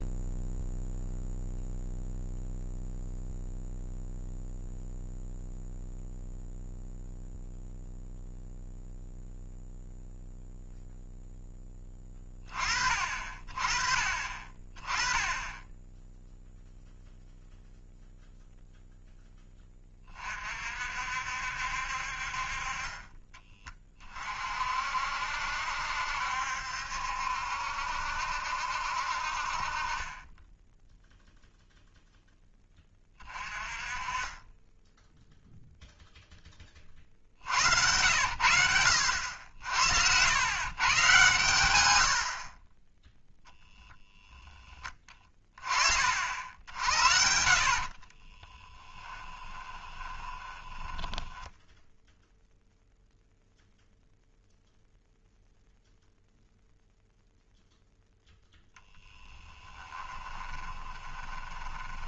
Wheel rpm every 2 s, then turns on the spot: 0, 0, 0, 0, 0, 0, 30, 30, 0, 0, 40, 40, 40, 70, 60, 10, 10, 20, 10, 80, 120, 30, 10, 70, 20, 10, 0, 0, 0, 0, 20.
48-52 60-62